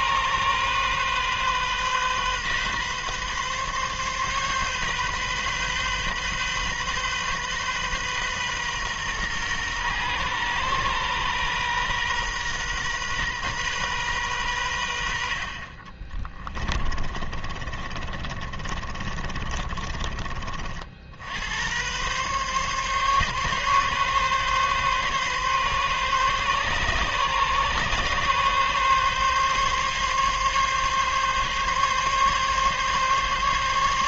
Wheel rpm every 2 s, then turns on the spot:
130, 130, 130, 130, 130, 120, 130, 100, 30, 30, 50, 140, 140, 140, 140, 140, 140.
16-20